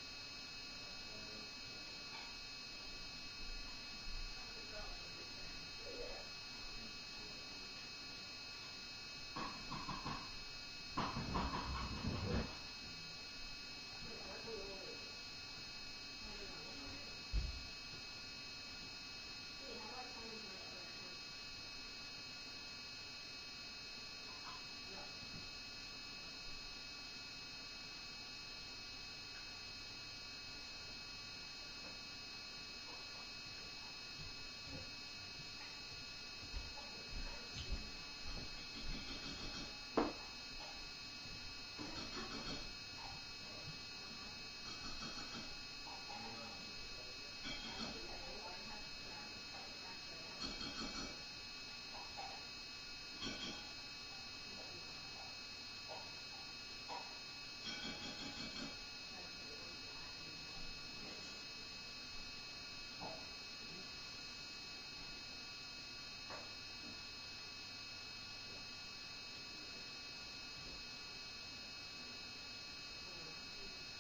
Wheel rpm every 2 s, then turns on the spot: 0, 0, 0, 0, 0, 0, 0, 0, 0, 0, 0, 0, 0, 0, 0, 0, 0, 0, 0, 0, 0, 0, 0, 0, 0, 0, 0, 0, 0, 0, 0, 0, 0, 0, 0, 0, 0.
none